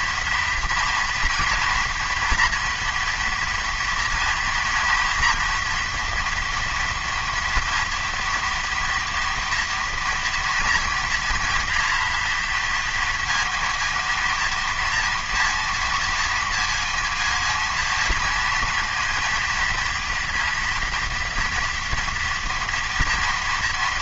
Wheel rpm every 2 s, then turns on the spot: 240, 230, 230, 240, 230, 230, 230, 230, 220, 230, 230, 230.
none